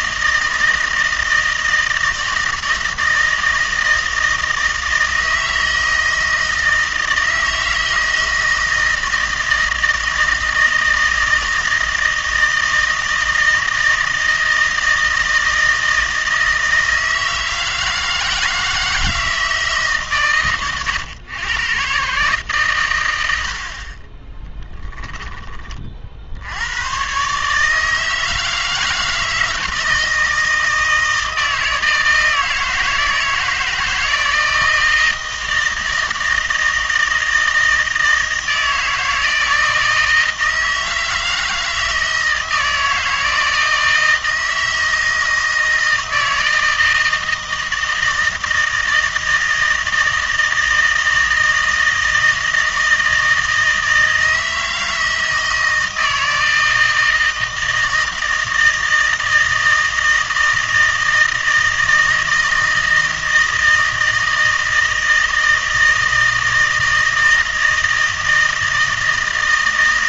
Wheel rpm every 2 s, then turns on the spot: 160, 160, 160, 160, 160, 160, 160, 160, 160, 160, 120, 130, 10, 80, 160, 160, 160, 160, 160, 160, 160, 160, 160, 160, 160, 160, 160, 160, 160, 160, 160, 160, 160, 160, 160.
24-26